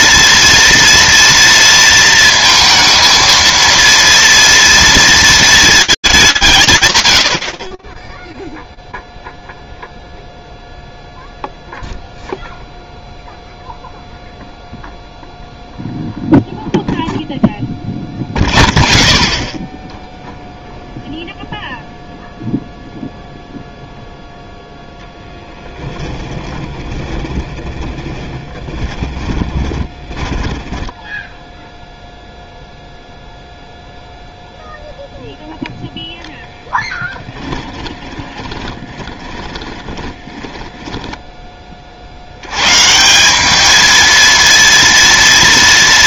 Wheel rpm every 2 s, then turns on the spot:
230, 230, 230, 170, 0, 0, 0, 0, 0, 0, 0, 0, 0, 20, 20, 10, 0, 0, 10, 20, 10, 110, 230.
26-32 38-42